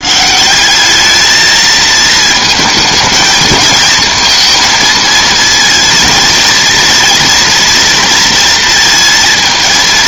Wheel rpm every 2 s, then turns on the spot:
200, 220, 230, 230, 230.
none